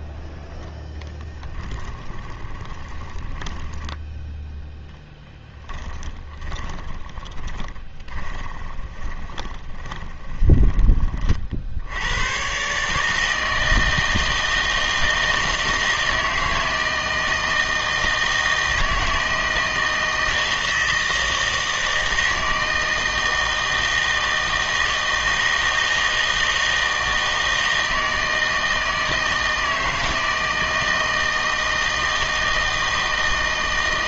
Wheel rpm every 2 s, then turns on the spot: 0, 20, 10, 10, 20, 20, 130, 160, 160, 160, 160, 160, 160, 160, 160, 160, 160.
2-4 6-10